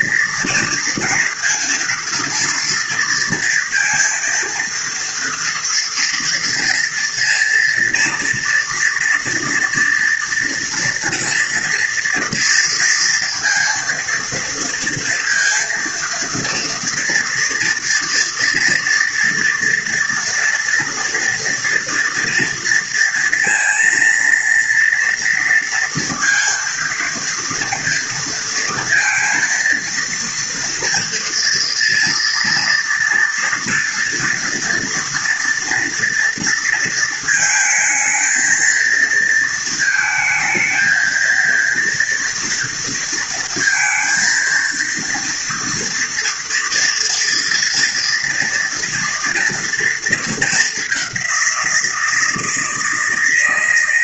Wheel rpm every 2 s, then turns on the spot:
230, 230, 230, 230, 230, 240, 230, 230, 230, 230, 230, 230, 230, 230, 230, 230, 230, 230, 230, 230, 220, 230, 230, 230, 240, 210, 160.
none